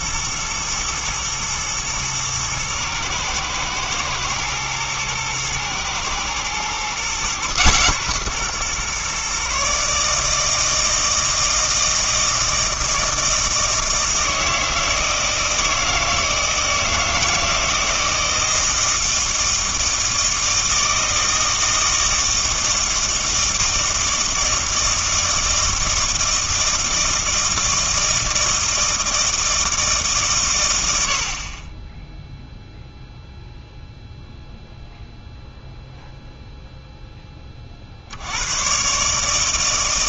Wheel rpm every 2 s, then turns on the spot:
110, 110, 110, 120, 130, 160, 160, 160, 160, 160, 160, 160, 160, 160, 160, 110, 0, 0, 0, 100.
none